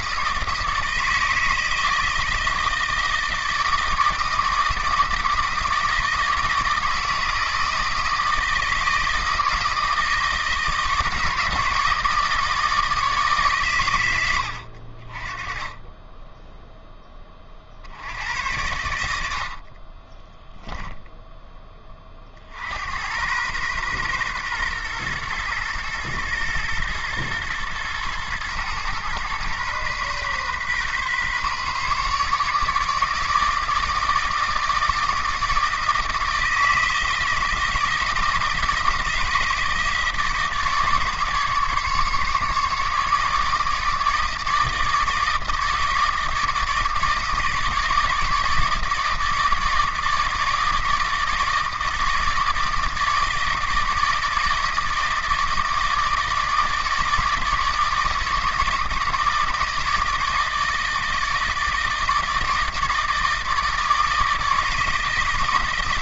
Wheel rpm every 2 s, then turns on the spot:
160, 160, 160, 160, 160, 160, 160, 60, 10, 90, 10, 80, 120, 110, 120, 130, 150, 160, 160, 160, 150, 150, 160, 160, 160, 160, 160, 160, 160, 160, 160, 160, 160.
20-22